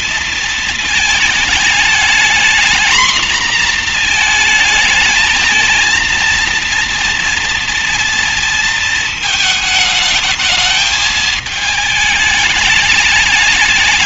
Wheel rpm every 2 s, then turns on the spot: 230, 230, 230, 230, 230, 220, 210.
none